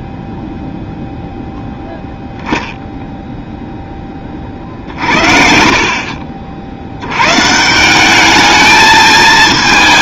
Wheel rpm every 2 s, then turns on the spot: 0, 0, 50, 110, 220.
none